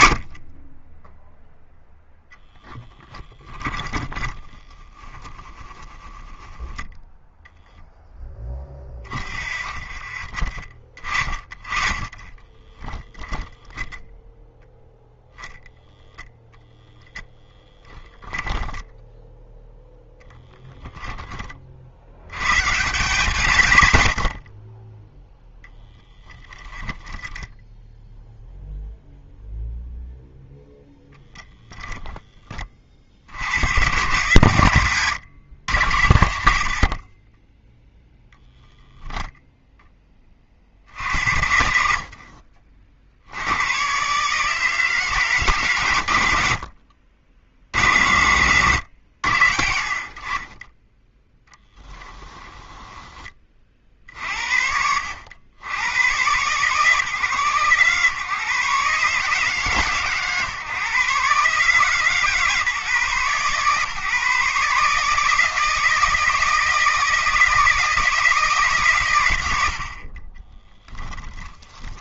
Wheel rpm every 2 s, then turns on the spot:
20, 10, 10, 0, 10, 30, 20, 0, 0, 10, 10, 160, 30, 10, 0, 0, 30, 130, 60, 0, 50, 50, 150, 60, 110, 20, 10, 70, 140, 140, 140, 140, 150, 160, 140, 10.
2-4 12-14 18-20 26-28 52-54 70-72